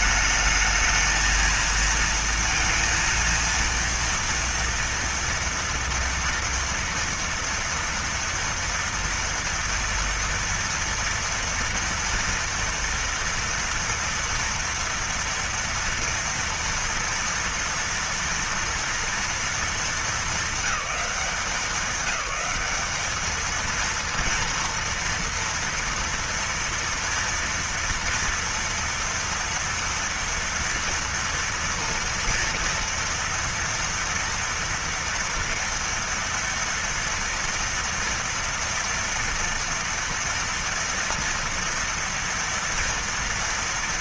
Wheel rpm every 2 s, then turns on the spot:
220, 230, 230, 230, 230, 230, 240, 230, 230, 230, 210, 200, 230, 240, 230, 230, 230, 230, 230, 230, 230, 230.
none